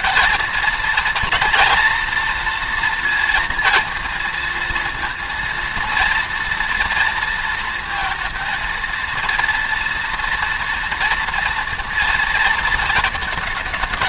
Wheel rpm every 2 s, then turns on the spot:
230, 230, 230, 230, 230, 240, 230.
none